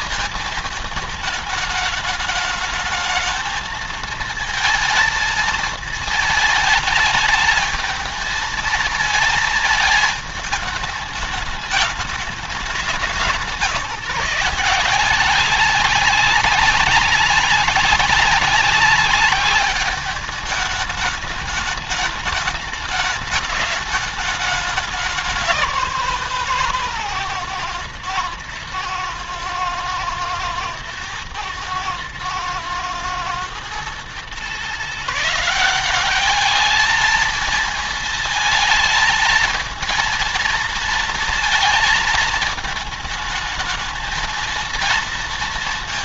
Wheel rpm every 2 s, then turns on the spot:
220, 220, 230, 220, 220, 210, 190, 180, 190, 200, 210, 210, 200, 140, 110, 120, 110, 150, 220, 220, 230, 220, 230.
none